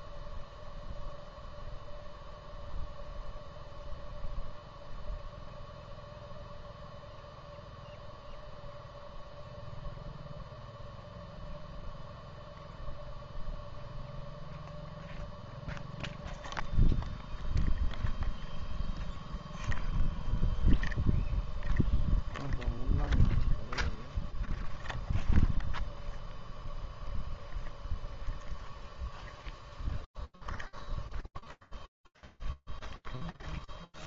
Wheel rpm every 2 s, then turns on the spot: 0, 0, 0, 0, 0, 0, 0, 0, 0, 0, 0, 0, 0, 0, 0, 0, 0.
none